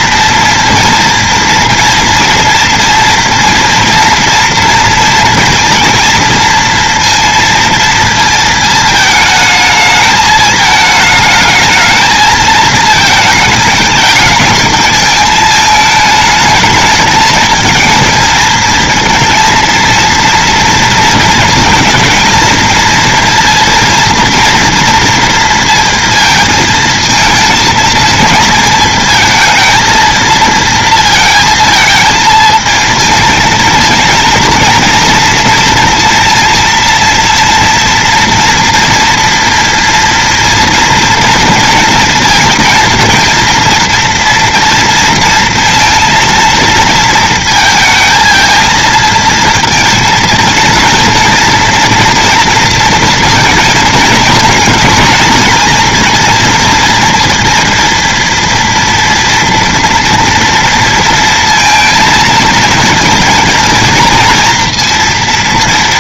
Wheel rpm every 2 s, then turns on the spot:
230, 230, 230, 230, 220, 220, 220, 220, 220, 230, 230, 230, 230, 230, 230, 230, 230, 230, 230, 230, 230, 230, 230, 230, 220, 230, 240, 230, 230, 230, 230, 230, 230.
none